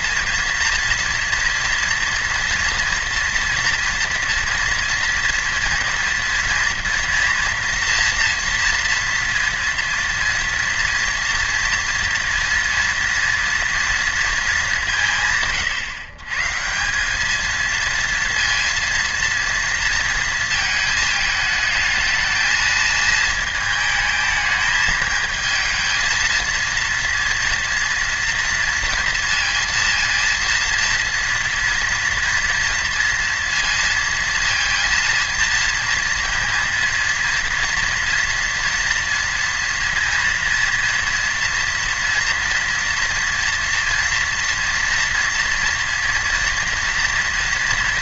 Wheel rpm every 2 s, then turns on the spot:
230, 230, 240, 240, 230, 230, 230, 210, 140, 230, 230, 220, 220, 230, 230, 230, 230, 230, 230, 230, 230, 240, 230, 230.
none